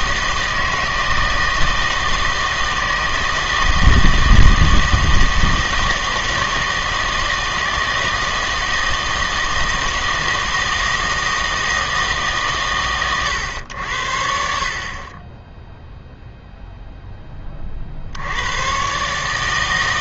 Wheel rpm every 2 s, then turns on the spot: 160, 160, 160, 160, 160, 160, 130, 60, 0, 110.
none